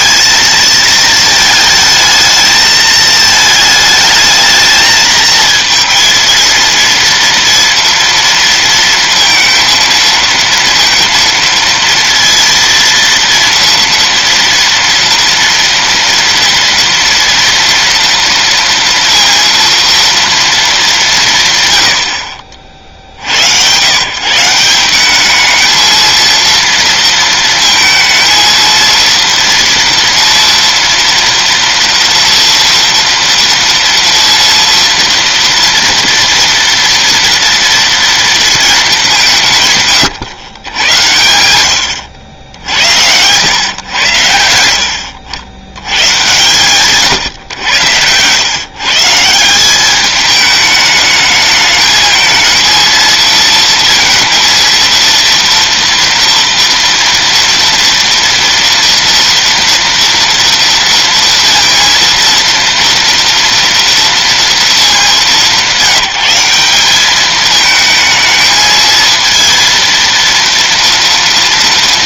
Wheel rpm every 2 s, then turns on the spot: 220, 220, 220, 230, 230, 230, 230, 230, 230, 230, 230, 60, 160, 230, 230, 230, 240, 230, 240, 220, 110, 80, 90, 120, 130, 210, 230, 230, 230, 230, 230, 230, 210, 190, 220, 230.
none